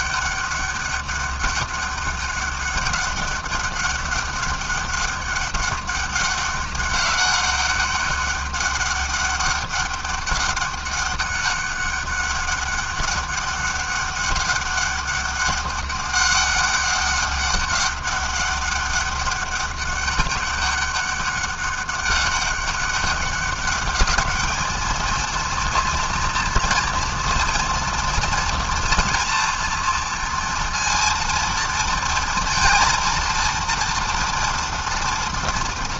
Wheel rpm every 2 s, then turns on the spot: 200, 200, 200, 190, 200, 200, 200, 200, 200, 200, 200, 200, 230, 230, 230, 230, 230, 230.
none